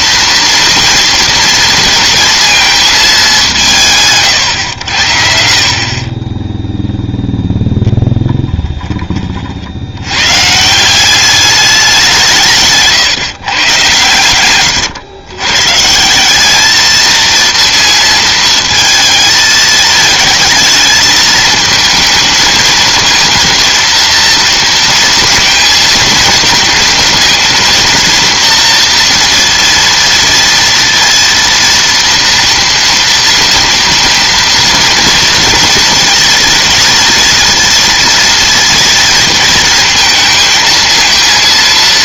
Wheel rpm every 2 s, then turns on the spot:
230, 230, 130, 10, 10, 120, 160, 110, 190, 230, 220, 220, 230, 230, 230, 230, 230, 230, 230, 230, 230.
none